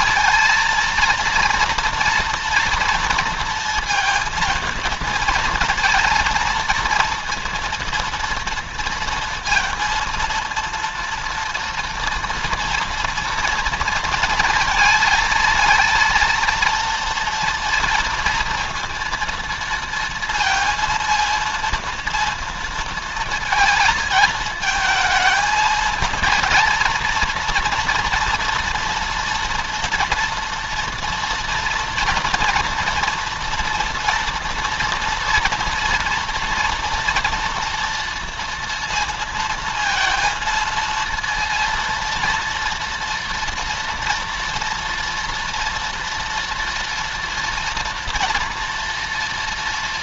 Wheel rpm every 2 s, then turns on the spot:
230, 230, 230, 230, 230, 230, 230, 230, 230, 230, 230, 230, 220, 230, 240, 230, 230, 230, 230, 230, 230, 230, 240, 230, 230.
none